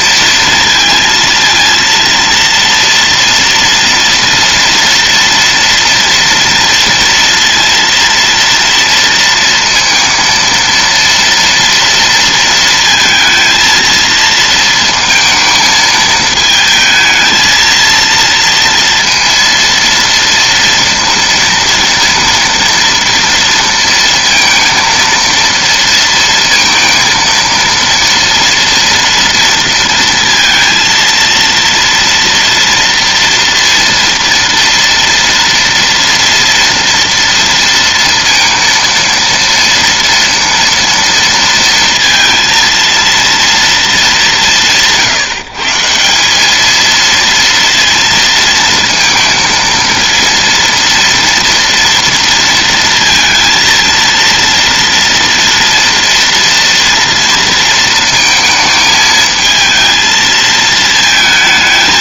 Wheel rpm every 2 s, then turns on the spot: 230, 230, 230, 240, 230, 230, 220, 220, 220, 230, 230, 230, 230, 230, 230, 230, 230, 230, 230, 230, 230, 230, 150, 230, 230, 230, 230, 230, 230, 220, 220.
none